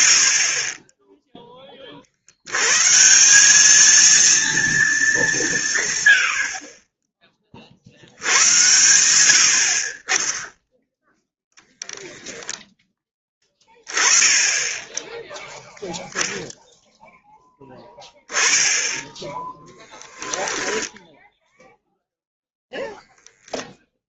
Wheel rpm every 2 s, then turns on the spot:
60, 130, 220, 30, 100, 0, 10, 10, 0, 10, 10, 0.
8-10